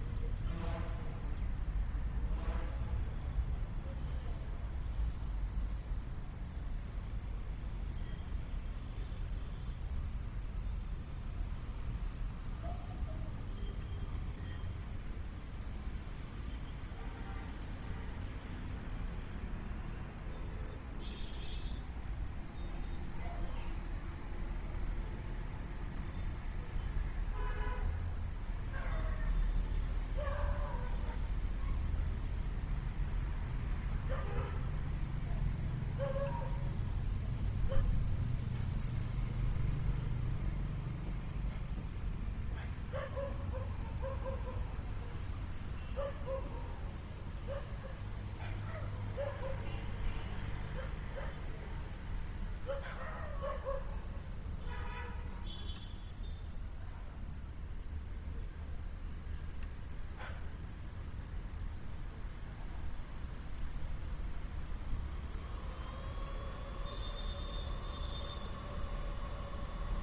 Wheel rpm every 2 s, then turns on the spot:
0, 0, 0, 0, 0, 0, 0, 0, 0, 0, 0, 0, 0, 0, 0, 0, 0, 0, 0, 0, 0, 0, 0, 0, 0, 0, 0, 0, 0, 0, 0, 0, 0, 0, 0.
none